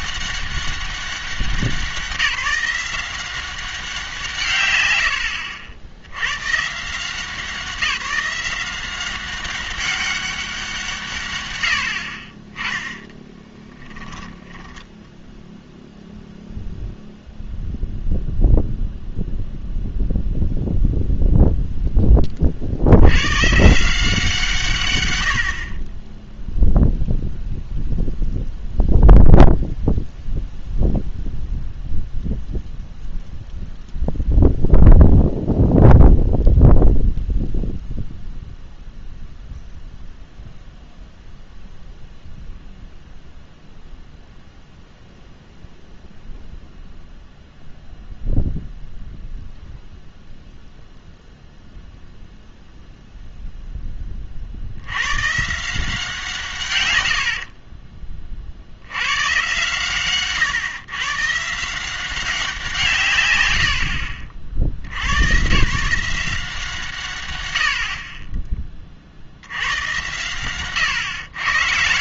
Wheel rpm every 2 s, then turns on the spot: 200, 170, 120, 140, 180, 170, 20, 10, 0, 0, 0, 60, 140, 0, 0, 0, 0, 0, 0, 0, 0, 0, 0, 0, 0, 0, 0, 70, 120, 60, 140, 160, 70, 150, 30, 120.
14-16